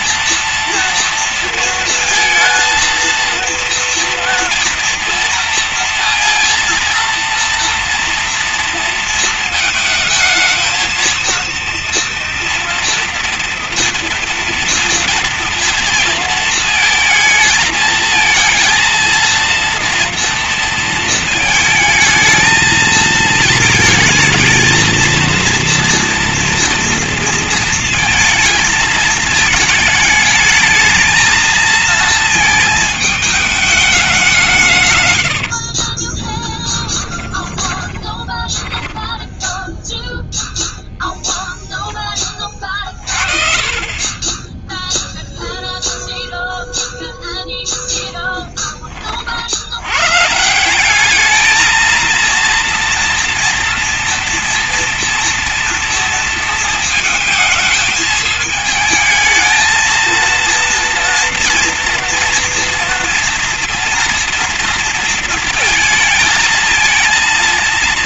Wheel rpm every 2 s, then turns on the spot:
240, 230, 230, 230, 230, 230, 240, 230, 230, 220, 230, 220, 220, 230, 220, 220, 220, 150, 10, 20, 0, 30, 10, 0, 10, 160, 230, 230, 220, 220, 230, 230, 230, 230.
36-40 42-46